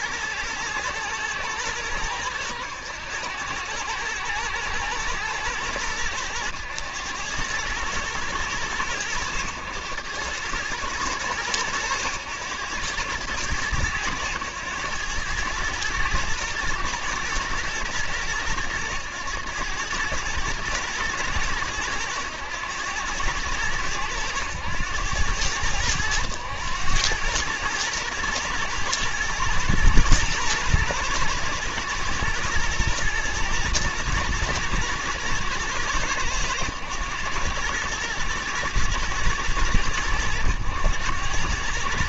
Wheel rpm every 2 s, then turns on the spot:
110, 100, 110, 100, 110, 110, 100, 110, 110, 110, 110, 110, 100, 100, 110, 120, 120, 120, 110, 120, 90.
none